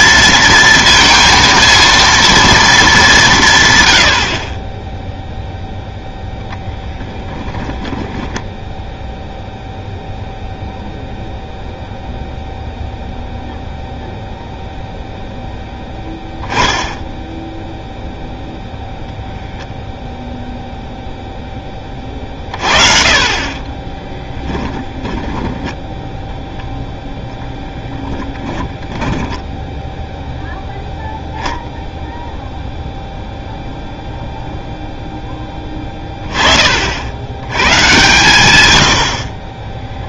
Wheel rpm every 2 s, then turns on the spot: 230, 210, 10, 10, 0, 0, 0, 0, 10, 0, 0, 40, 10, 10, 20, 0, 0, 0, 50, 90.
24-26 28-30